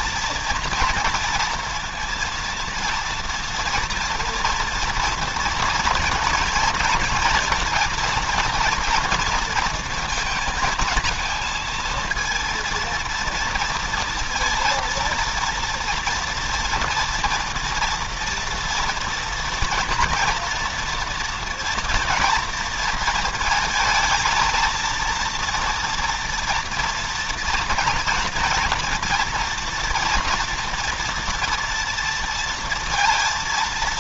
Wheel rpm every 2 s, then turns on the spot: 230, 230, 230, 230, 230, 220, 230, 230, 230, 230, 240, 230, 230, 230, 230, 230, 230.
none